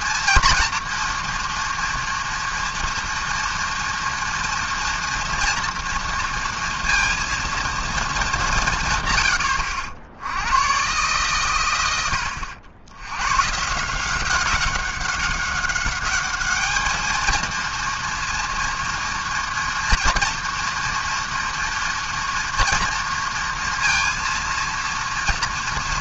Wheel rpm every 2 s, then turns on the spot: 230, 230, 230, 230, 170, 110, 90, 190, 210, 230, 230, 230, 230.
none